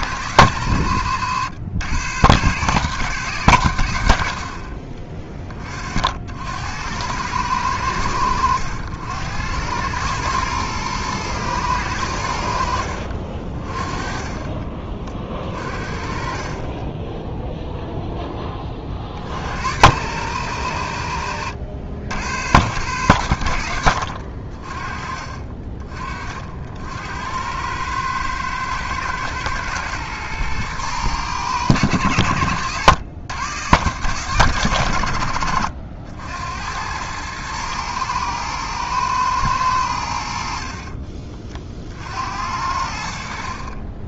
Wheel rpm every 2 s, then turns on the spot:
100, 120, 50, 80, 80, 110, 70, 30, 30, 20, 100, 110, 50, 60, 110, 110, 90, 130, 80, 110, 60, 70.
16-18 32-34